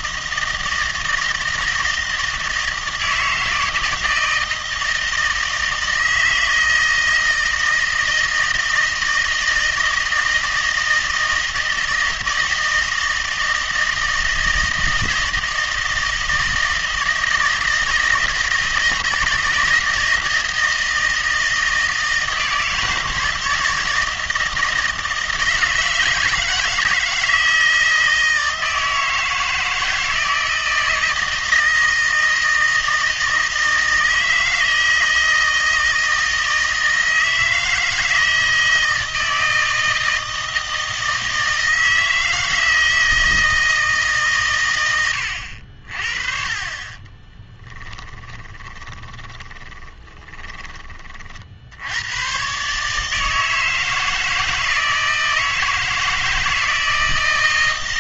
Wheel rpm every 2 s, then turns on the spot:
160, 160, 160, 160, 160, 160, 160, 160, 160, 160, 160, 160, 160, 160, 160, 160, 160, 160, 160, 160, 160, 160, 100, 30, 10, 30, 140, 160, 160.
48-50